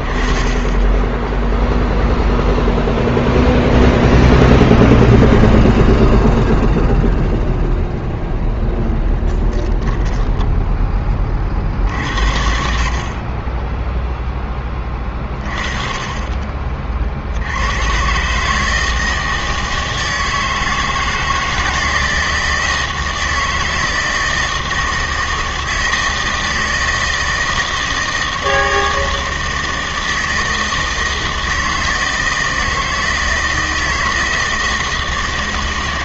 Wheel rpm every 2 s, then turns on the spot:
10, 0, 0, 0, 0, 10, 50, 20, 40, 160, 160, 160, 160, 160, 160, 160, 160, 160.
none